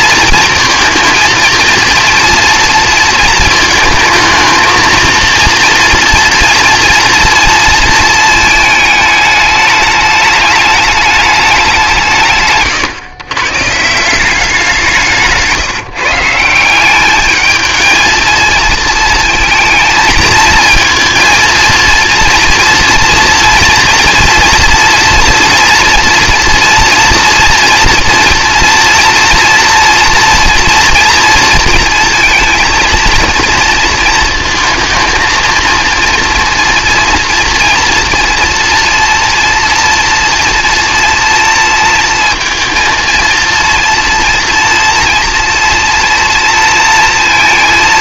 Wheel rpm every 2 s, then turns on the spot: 220, 230, 220, 230, 220, 210, 120, 180, 180, 230, 220, 230, 240, 230, 230, 230, 230, 230, 230, 240, 240, 230, 230, 230.
none